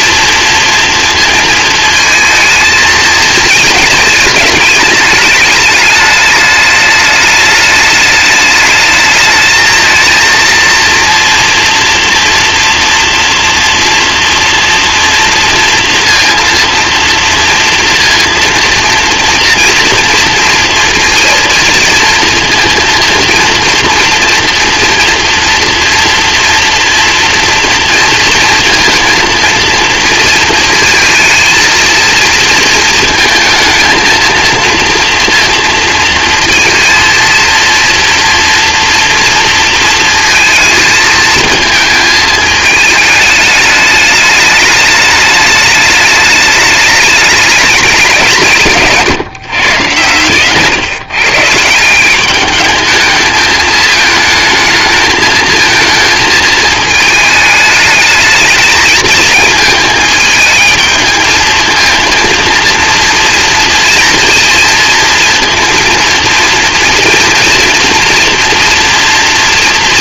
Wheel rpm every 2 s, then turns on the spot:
230, 220, 210, 210, 210, 230, 230, 230, 230, 230, 230, 230, 240, 230, 230, 230, 230, 230, 230, 230, 220, 220, 210, 210, 160, 130, 210, 220, 220, 220, 220, 230, 230, 230, 230.
none